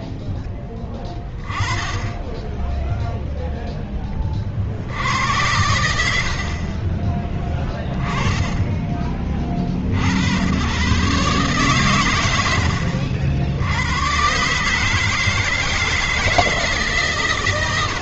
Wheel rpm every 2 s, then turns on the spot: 10, 10, 60, 30, 20, 100, 90, 140, 160.
6-8